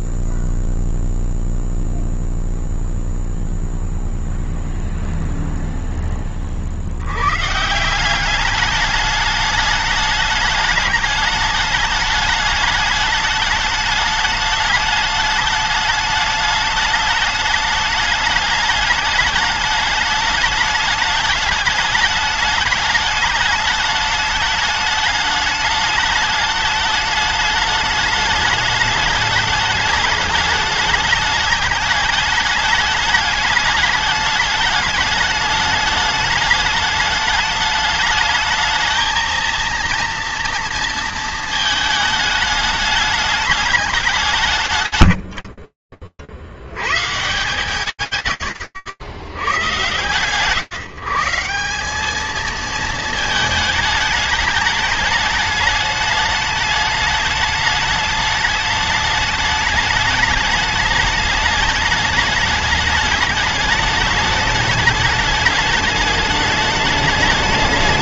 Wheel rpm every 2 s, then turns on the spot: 0, 0, 0, 0, 140, 210, 210, 210, 210, 210, 210, 210, 210, 210, 210, 210, 210, 210, 210, 210, 230, 220, 190, 110, 110, 150, 220, 210, 210, 210, 210, 210, 210, 210.
none